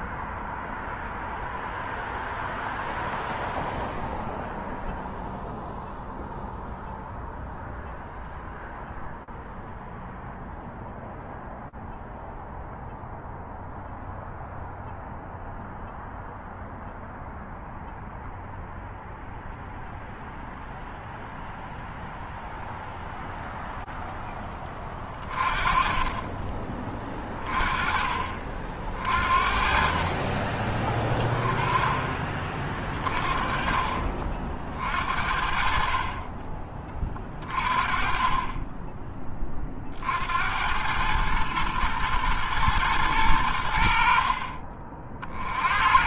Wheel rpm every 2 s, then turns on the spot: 0, 0, 0, 0, 0, 0, 0, 0, 0, 0, 0, 0, 10, 30, 30, 40, 30, 50, 20, 30, 80, 120, 50.
none